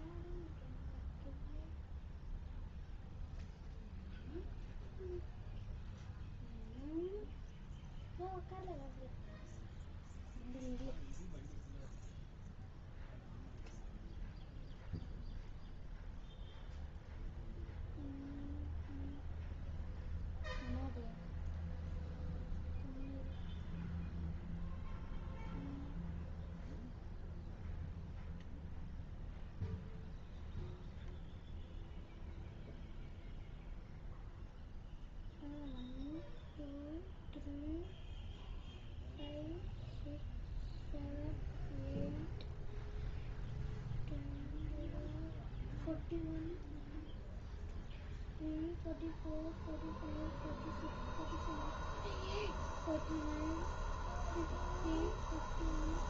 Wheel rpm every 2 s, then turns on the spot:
0, 0, 0, 0, 0, 0, 0, 0, 0, 0, 0, 0, 0, 0, 0, 0, 0, 0, 0, 0, 0, 0, 0, 0, 0, 0, 0, 0.
none